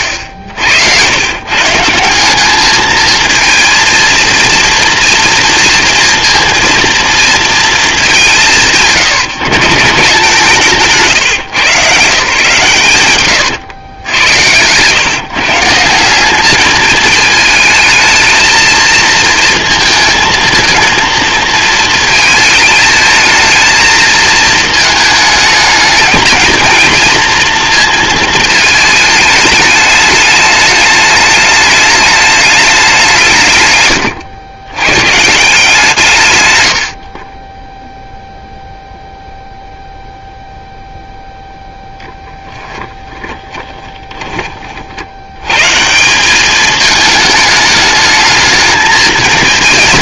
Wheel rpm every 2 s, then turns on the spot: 90, 220, 230, 230, 160, 140, 120, 130, 210, 230, 230, 220, 220, 230, 210, 210, 160, 130, 30, 0, 0, 20, 80, 220, 220.
8-10 42-44